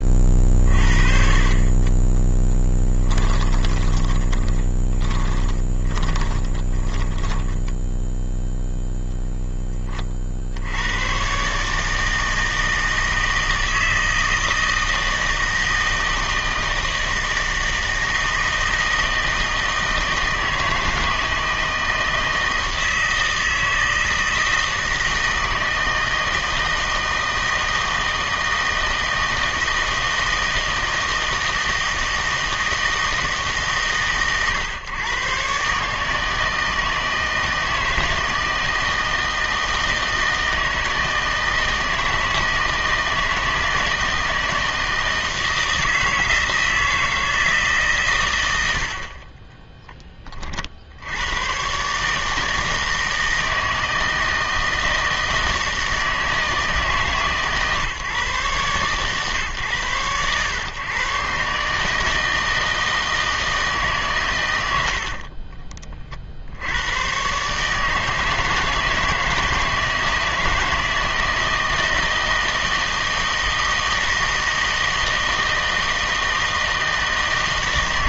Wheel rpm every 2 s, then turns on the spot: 40, 10, 30, 20, 0, 90, 160, 160, 160, 160, 160, 160, 160, 160, 160, 160, 160, 130, 160, 160, 160, 160, 160, 160, 80, 60, 160, 160, 150, 130, 120, 160, 80, 100, 160, 160, 160, 160, 160.
2-8